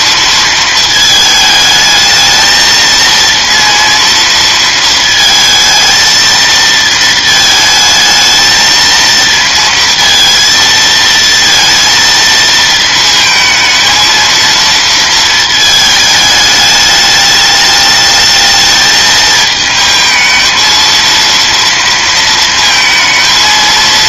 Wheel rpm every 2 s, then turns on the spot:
220, 220, 230, 230, 230, 230, 220, 230, 210, 220, 230, 230.
none